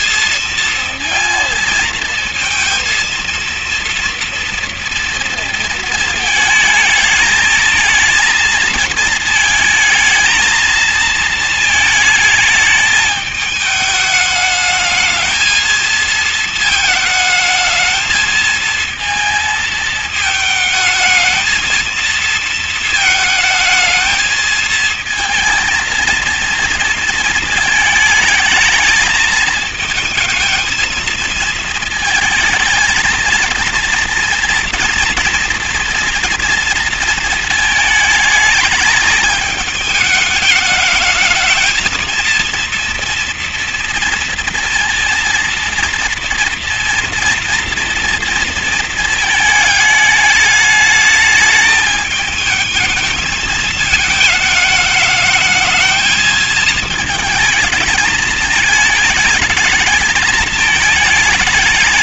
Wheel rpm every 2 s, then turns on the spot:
220, 230, 230, 220, 220, 230, 220, 210, 220, 230, 220, 230, 230, 230, 220, 220, 220, 230, 230, 220, 210, 230, 230, 230, 230, 210, 220, 220, 220, 220, 210.
none